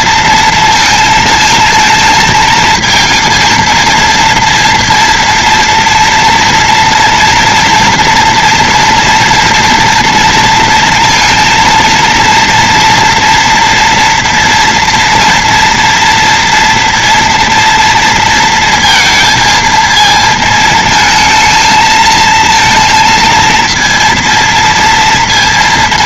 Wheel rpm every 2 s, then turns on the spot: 230, 230, 230, 230, 230, 230, 230, 230, 230, 230, 220, 230, 230.
none